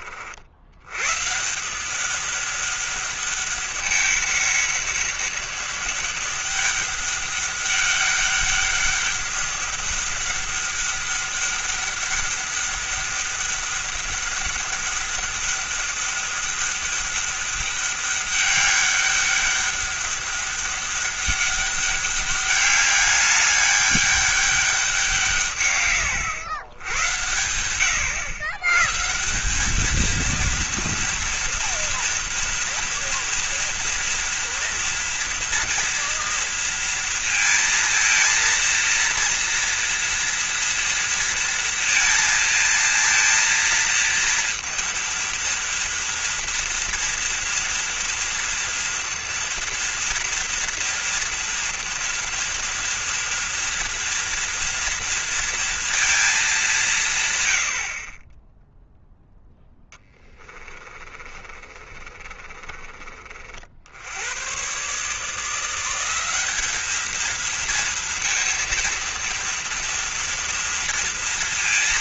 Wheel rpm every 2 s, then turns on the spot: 100, 200, 200, 200, 200, 200, 200, 200, 200, 200, 200, 200, 200, 110, 130, 230, 230, 230, 230, 230, 230, 230, 230, 230, 230, 230, 230, 230, 180, 0, 30, 30, 130, 210, 230, 230.
60-62